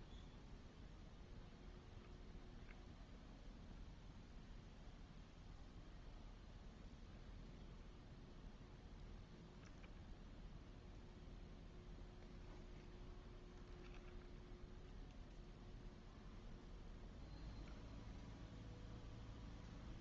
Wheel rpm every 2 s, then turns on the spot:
0, 0, 0, 0, 0, 0, 0, 0, 0, 0.
none